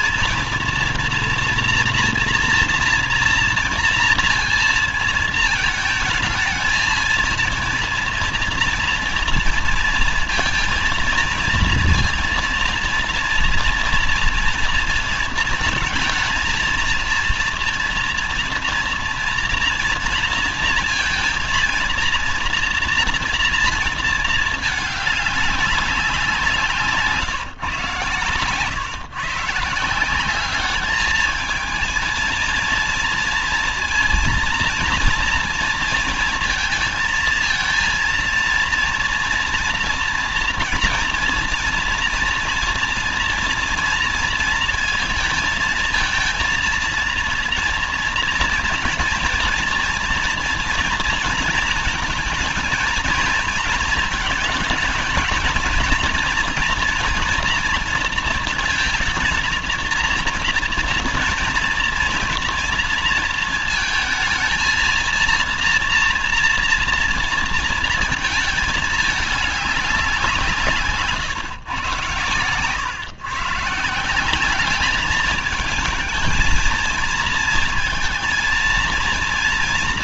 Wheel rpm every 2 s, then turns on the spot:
230, 230, 230, 220, 230, 230, 230, 230, 230, 230, 230, 240, 220, 180, 120, 200, 230, 230, 230, 230, 230, 230, 230, 230, 230, 230, 220, 220, 240, 230, 230, 230, 230, 230, 210, 160, 120, 200, 220, 230.
none